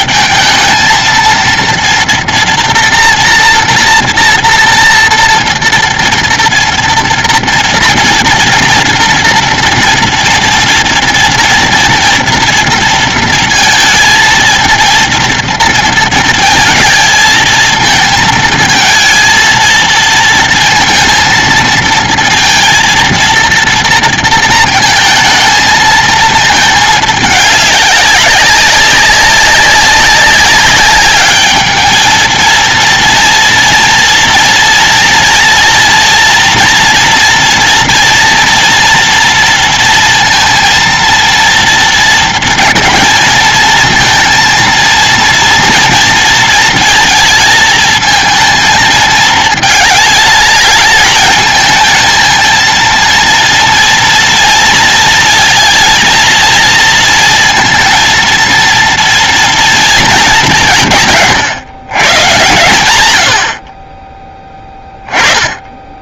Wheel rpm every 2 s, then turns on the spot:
220, 230, 230, 230, 240, 230, 230, 230, 220, 230, 230, 230, 220, 210, 200, 200, 230, 230, 230, 230, 230, 230, 230, 230, 220, 210, 230, 230, 230, 230, 160, 110, 20.
none